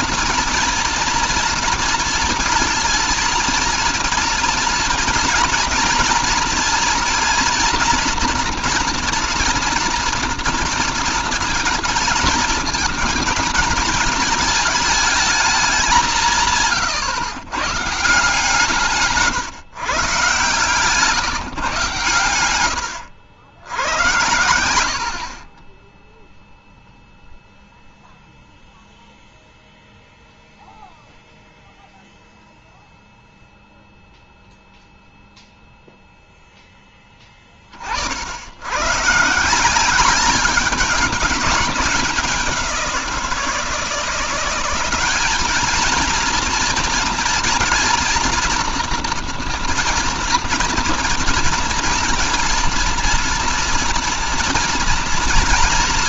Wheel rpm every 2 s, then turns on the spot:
230, 230, 230, 240, 230, 230, 220, 220, 150, 160, 150, 120, 80, 0, 0, 0, 0, 0, 10, 90, 200, 190, 190, 230, 230, 230, 240, 230.
none